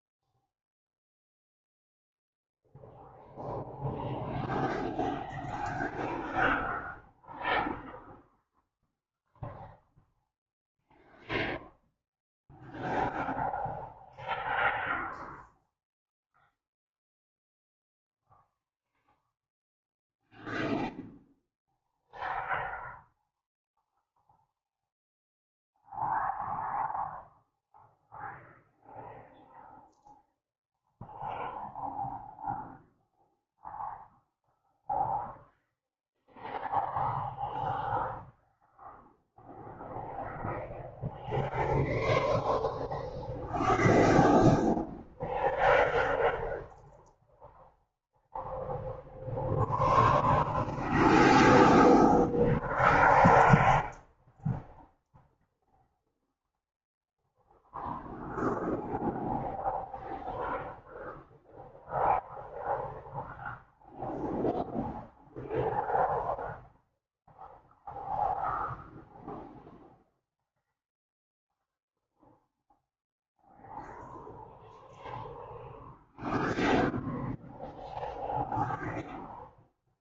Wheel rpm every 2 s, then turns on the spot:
0, 0, 0, 0, 0, 0, 0, 0, 0, 0, 0, 0, 0, 0, 0, 0, 0, 0, 0, 0, 0, 0, 0, 0, 0, 0, 0, 0, 0, 0, 0, 0, 0, 0, 0, 0, 0, 0, 0, 0.
none